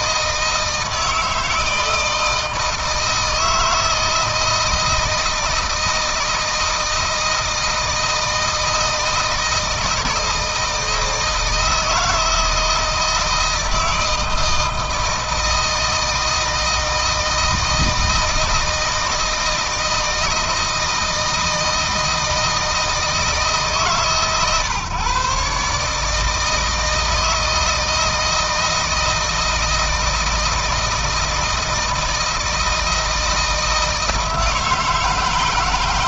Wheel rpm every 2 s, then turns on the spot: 160, 160, 160, 160, 160, 160, 160, 160, 160, 160, 160, 160, 130, 160, 160, 160, 160, 160.
none